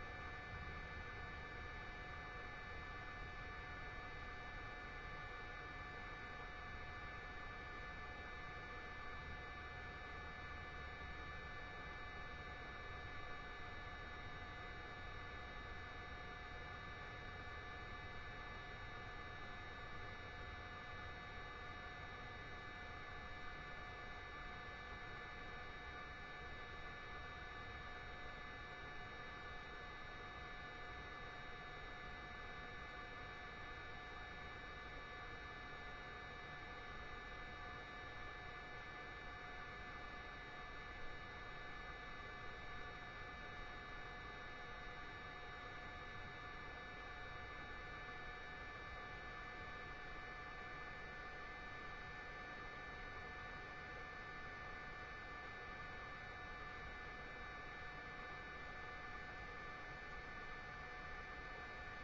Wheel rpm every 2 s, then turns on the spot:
0, 0, 0, 0, 0, 0, 0, 0, 0, 0, 0, 0, 0, 0, 0, 0, 0, 0, 0, 0, 0, 0, 0, 0, 0, 0, 0, 0, 0, 0, 0.
none